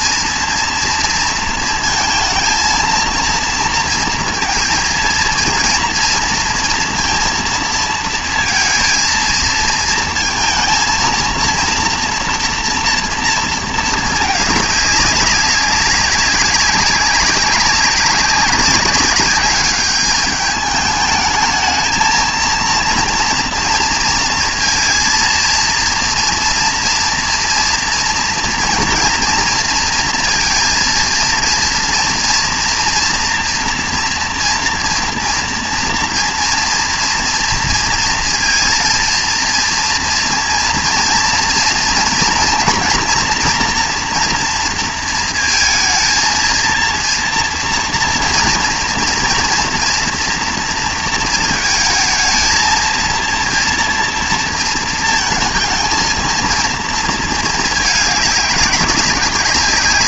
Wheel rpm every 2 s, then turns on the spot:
230, 230, 230, 230, 230, 220, 230, 210, 190, 190, 210, 240, 230, 230, 230, 230, 230, 230, 240, 230, 230, 230, 230, 230, 230, 230, 220, 230, 230, 200.
none